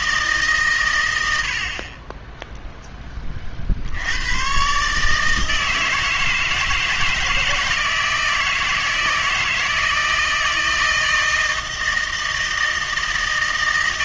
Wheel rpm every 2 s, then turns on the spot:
140, 0, 120, 160, 160, 160, 160.
none